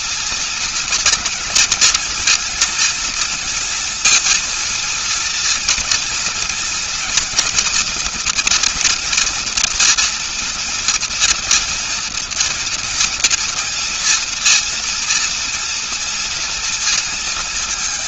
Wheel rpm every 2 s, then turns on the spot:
230, 230, 230, 230, 230, 230, 240, 240, 230.
none